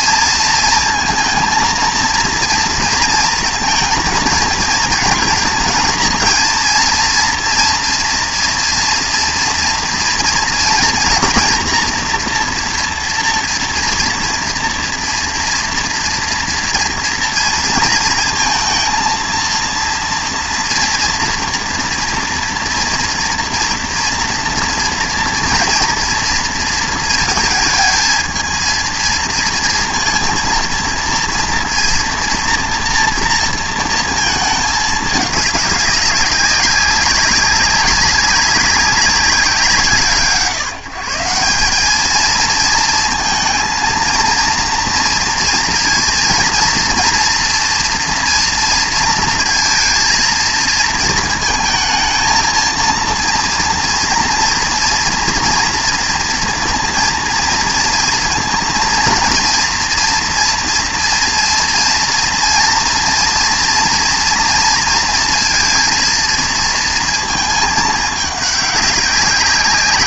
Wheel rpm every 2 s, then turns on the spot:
230, 230, 230, 230, 230, 230, 240, 230, 240, 230, 240, 240, 230, 220, 220, 230, 230, 220, 190, 190, 140, 220, 230, 230, 230, 230, 230, 230, 230, 230, 230, 230, 230, 230, 200.
none